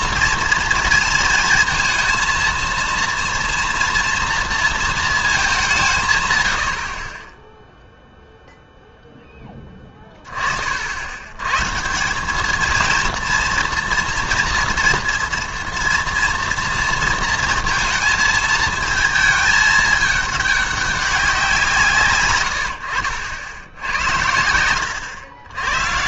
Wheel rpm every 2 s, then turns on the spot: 230, 230, 230, 90, 0, 50, 220, 230, 230, 220, 200, 90, 90.
none